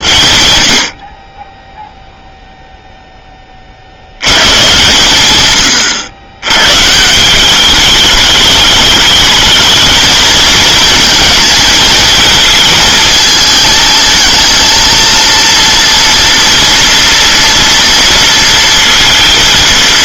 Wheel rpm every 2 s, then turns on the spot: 60, 0, 120, 120, 210, 220, 220, 230, 240, 230.
none